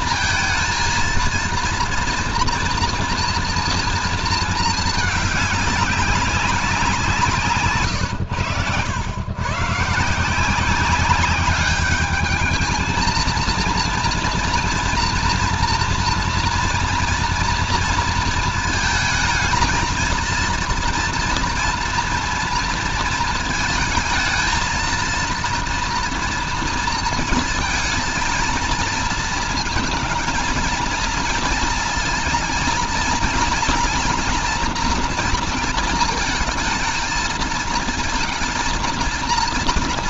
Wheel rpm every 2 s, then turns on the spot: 230, 230, 220, 180, 110, 190, 220, 240, 230, 230, 230, 230, 230, 230, 230, 220, 230, 240, 220, 230.
none